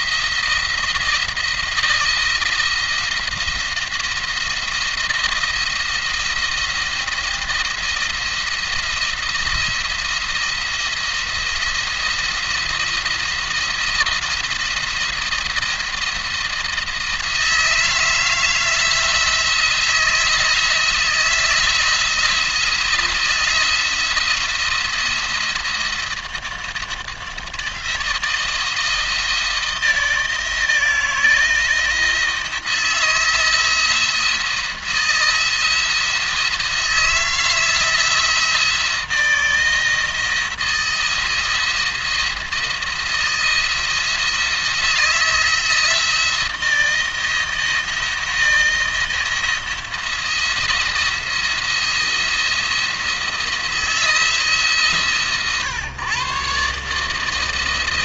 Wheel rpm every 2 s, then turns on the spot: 170, 170, 170, 170, 170, 170, 170, 170, 170, 160, 160, 160, 170, 170, 170, 170, 160, 170, 170, 170, 170, 170, 170, 170, 160, 170, 170, 150, 140.
none